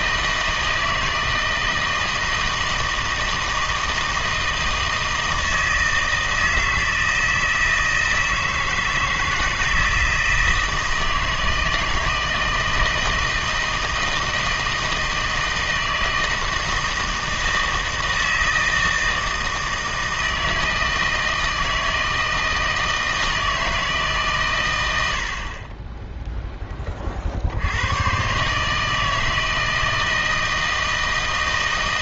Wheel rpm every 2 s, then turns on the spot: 160, 160, 160, 160, 160, 160, 160, 160, 160, 160, 160, 160, 100, 20, 150, 160.
none